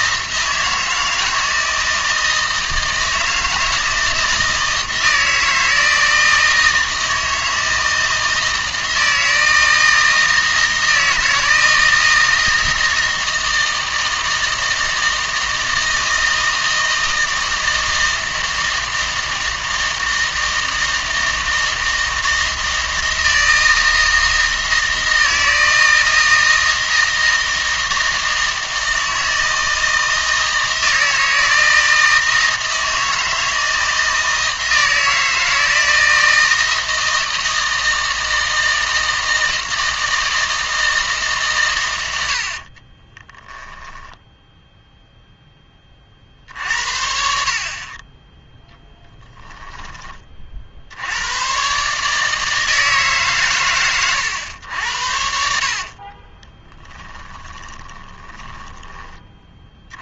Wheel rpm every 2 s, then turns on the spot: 160, 160, 160, 160, 160, 160, 160, 160, 160, 160, 160, 160, 160, 160, 160, 160, 160, 160, 160, 160, 160, 30, 0, 60, 10, 70, 150, 80, 20, 20.
42-44 48-50 56-58